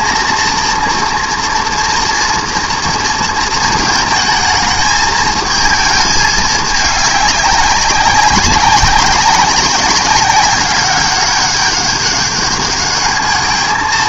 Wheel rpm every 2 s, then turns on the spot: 230, 220, 220, 200, 200, 200, 220.
none